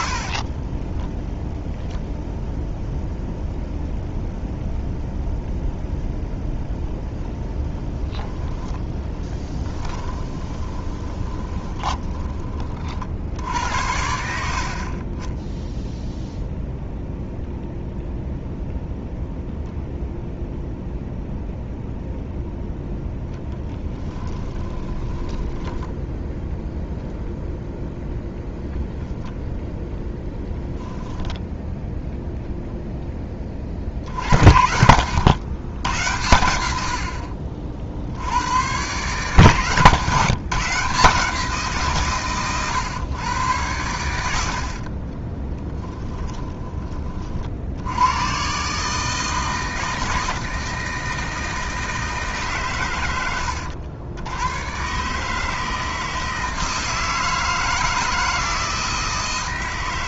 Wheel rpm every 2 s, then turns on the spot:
30, 0, 0, 10, 10, 10, 40, 70, 0, 0, 0, 0, 10, 0, 0, 10, 0, 80, 80, 130, 150, 120, 60, 30, 150, 160, 130, 120, 160, 160.
0-2 10-12 24-26 30-32